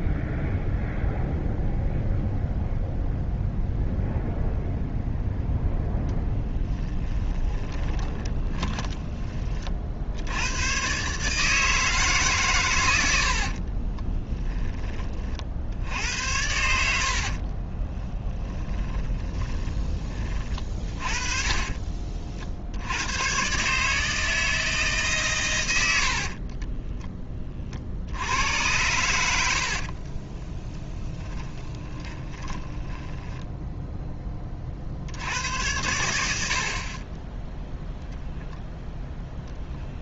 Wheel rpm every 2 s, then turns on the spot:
0, 0, 0, 10, 10, 110, 110, 20, 80, 10, 40, 70, 150, 10, 100, 10, 10, 40, 50, 0.
6-10 16-22 26-28 30-34